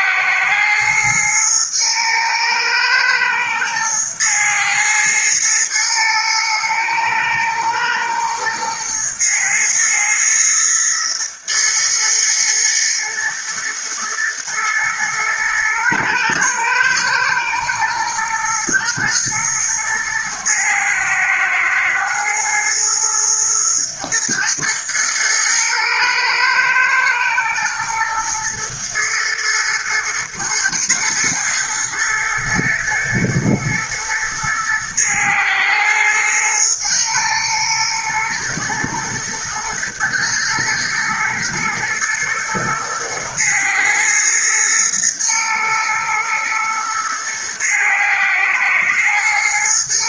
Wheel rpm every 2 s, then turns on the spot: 110, 110, 110, 110, 110, 110, 110, 110, 120, 120, 110, 120, 110, 110, 110, 120, 110, 110, 110, 120, 110, 110, 120, 110, 110.
none